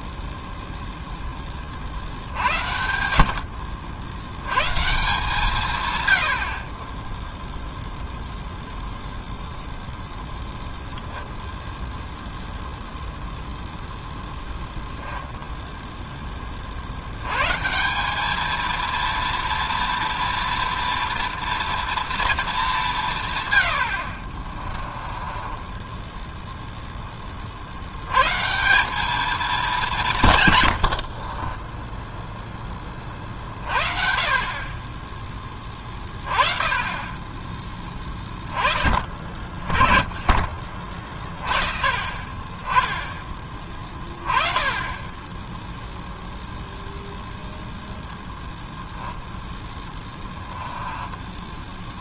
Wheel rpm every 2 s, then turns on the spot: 0, 70, 130, 50, 0, 0, 0, 0, 50, 230, 230, 200, 20, 0, 190, 100, 20, 30, 20, 20, 40, 20, 10, 0, 0, 10.
24-26 50-52